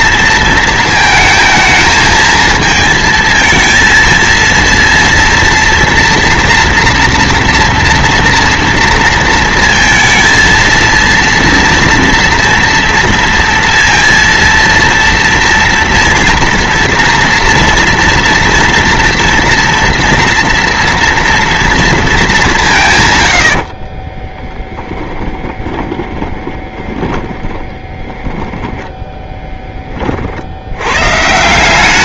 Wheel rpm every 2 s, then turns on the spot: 230, 220, 230, 240, 230, 230, 230, 230, 240, 240, 230, 200, 20, 20, 10, 70.
24-28